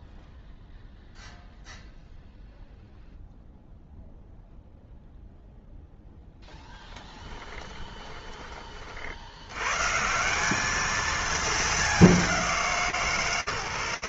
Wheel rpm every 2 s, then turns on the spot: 0, 0, 0, 10, 60, 220, 140.
6-8